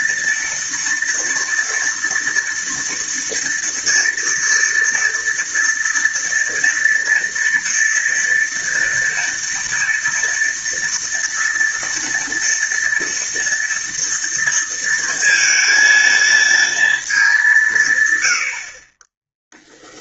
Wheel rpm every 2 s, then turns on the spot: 230, 230, 230, 230, 230, 230, 230, 230, 230, 60.
none